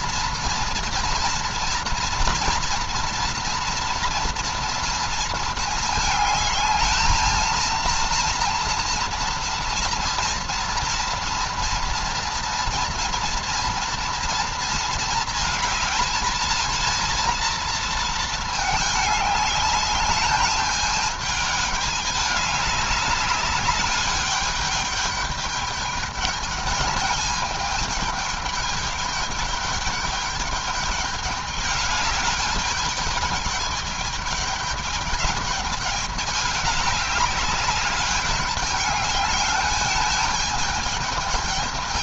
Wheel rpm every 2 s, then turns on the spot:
230, 230, 230, 220, 240, 230, 230, 220, 220, 210, 210, 200, 210, 210, 210, 210, 210, 210, 200, 210, 210.
none